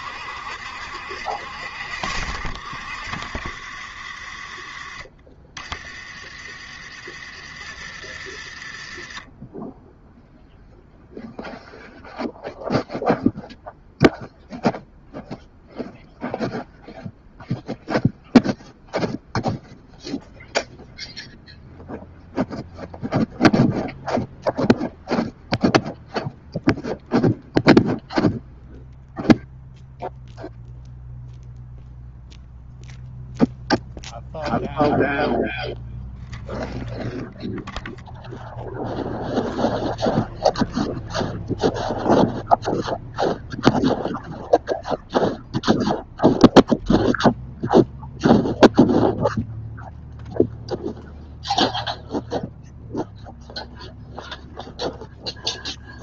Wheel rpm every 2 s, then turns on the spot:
70, 60, 30, 50, 30, 0, 0, 0, 0, 0, 0, 0, 0, 0, 0, 0, 0, 0, 0, 0, 0, 0, 0, 0, 0, 0, 0, 0.
none